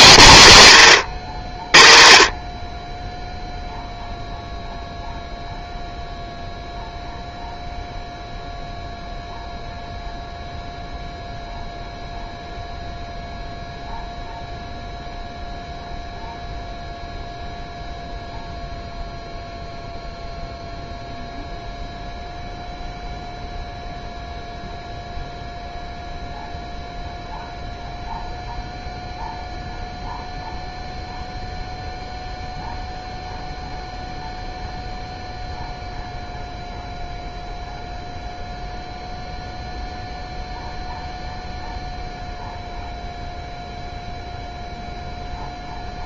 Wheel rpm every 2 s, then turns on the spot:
140, 30, 0, 0, 0, 0, 0, 0, 0, 0, 0, 0, 0, 0, 0, 0, 0, 0, 0, 0, 0, 0, 0.
none